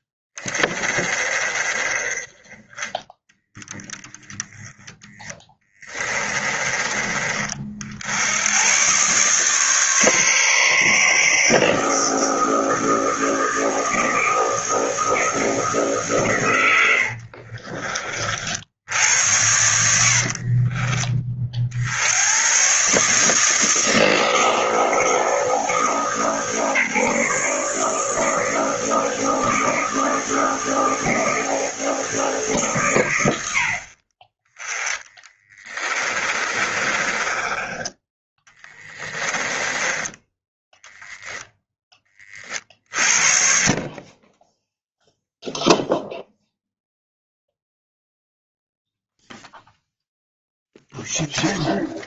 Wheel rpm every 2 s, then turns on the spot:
30, 20, 10, 20, 120, 140, 160, 160, 90, 80, 40, 130, 160, 150, 160, 160, 120, 10, 30, 10, 10, 40, 0, 0, 0, 0.
16-18 20-22 34-40